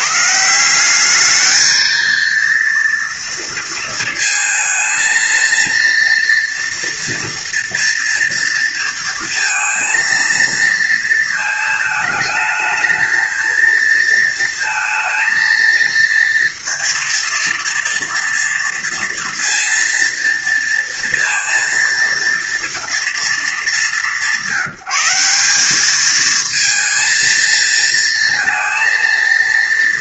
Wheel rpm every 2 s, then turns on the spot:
170, 230, 220, 230, 230, 230, 220, 230, 230, 230, 230, 230, 180, 220, 230.
none